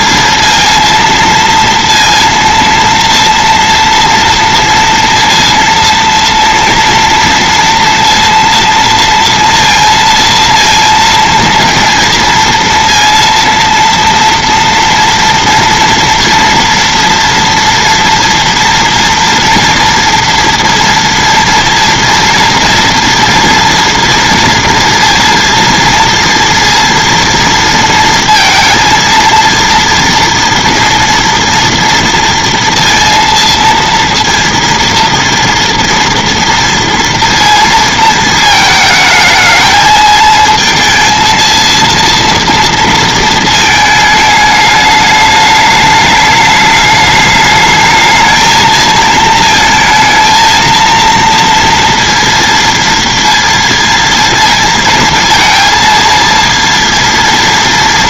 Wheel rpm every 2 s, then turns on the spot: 230, 230, 230, 230, 230, 230, 230, 230, 230, 230, 230, 230, 230, 230, 230, 230, 230, 230, 230, 220, 220, 230, 210, 210, 220, 220, 230, 230, 230.
none